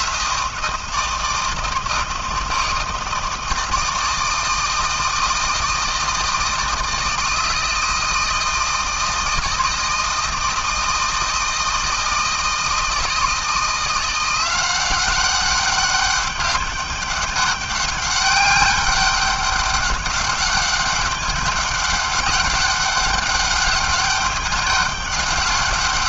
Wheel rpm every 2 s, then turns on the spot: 160, 160, 160, 160, 160, 160, 160, 180, 200, 200, 200, 200, 200.
none